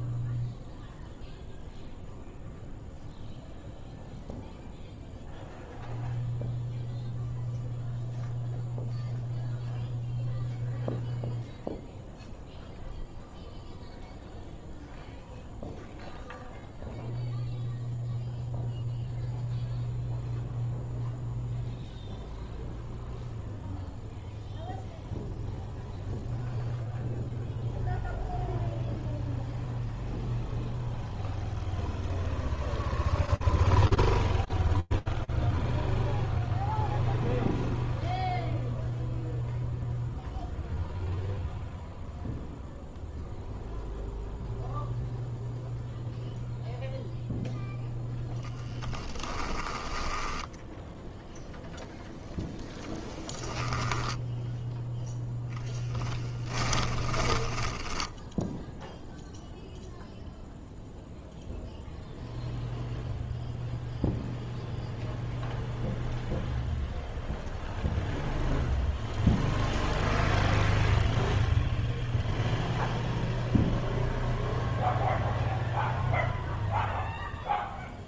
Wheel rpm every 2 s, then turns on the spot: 0, 0, 0, 0, 0, 0, 0, 0, 0, 0, 0, 0, 0, 0, 0, 0, 0, 0, 0, 0, 0, 0, 0, 0, 10, 0, 10, 0, 10, 0, 0, 0, 0, 0, 0, 0, 0, 0, 0.
48-50 52-54 56-58